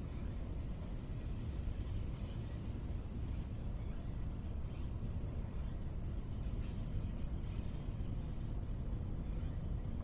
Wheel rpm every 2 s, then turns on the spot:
0, 0, 0, 0, 0.
none